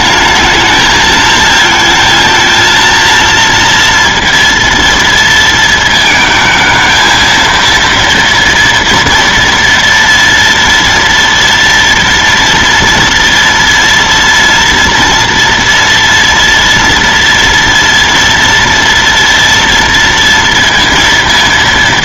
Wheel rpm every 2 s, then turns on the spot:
220, 230, 230, 220, 230, 230, 230, 230, 230, 230, 230.
none